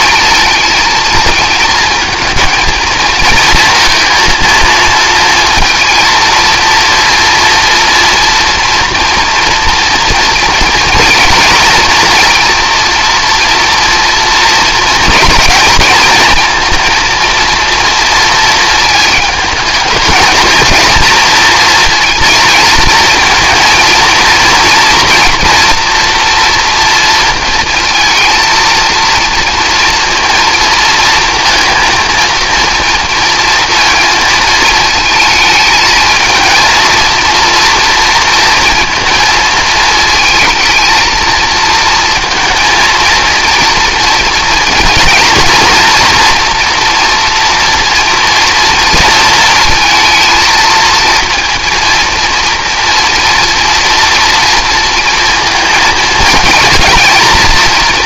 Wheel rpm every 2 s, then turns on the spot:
220, 230, 230, 230, 230, 230, 230, 230, 230, 230, 230, 220, 230, 240, 230, 230, 230, 230, 220, 230, 220, 230, 230, 240, 230, 230, 230, 230, 220.
none